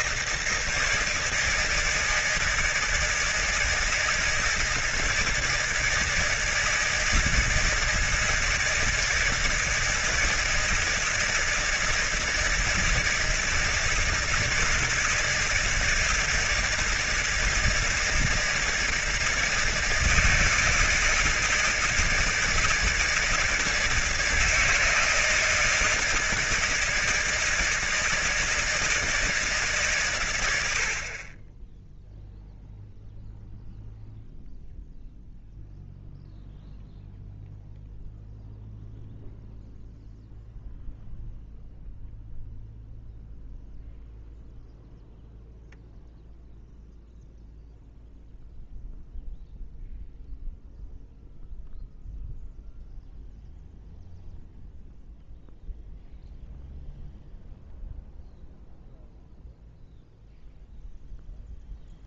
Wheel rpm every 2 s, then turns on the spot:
160, 160, 160, 160, 160, 160, 160, 160, 160, 160, 160, 160, 160, 160, 170, 100, 0, 0, 0, 0, 0, 0, 0, 0, 0, 0, 0, 0, 0, 0, 0.
none